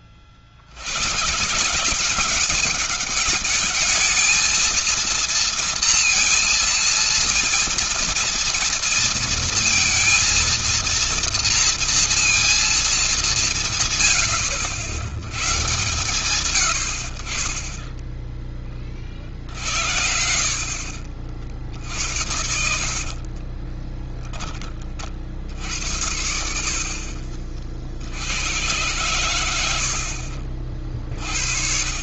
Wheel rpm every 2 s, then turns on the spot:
90, 200, 230, 230, 230, 230, 210, 80, 90, 30, 60, 50, 30, 60, 110, 40.
22-24